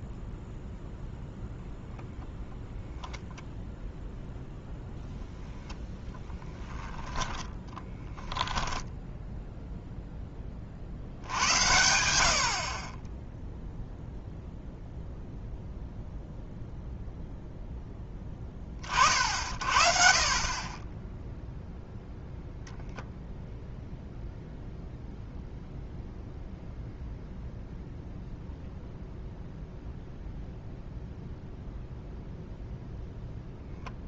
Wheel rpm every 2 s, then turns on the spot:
0, 0, 0, 20, 10, 40, 40, 0, 0, 30, 30, 0, 0, 0, 0, 0, 0.
6-10